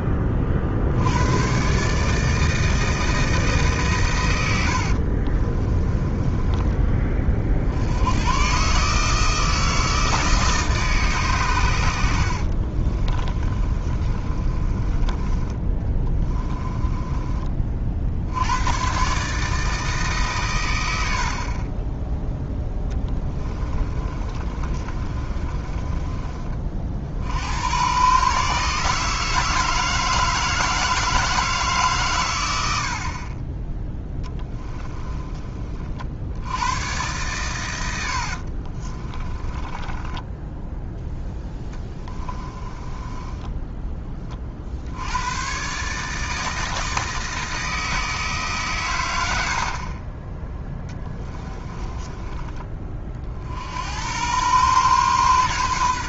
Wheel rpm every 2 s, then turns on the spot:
40, 160, 70, 20, 140, 150, 30, 20, 20, 110, 100, 10, 30, 40, 150, 160, 70, 10, 110, 40, 10, 20, 60, 160, 130, 10, 30, 120.
4-6 12-18 22-26 34-36 38-40 42-44 50-52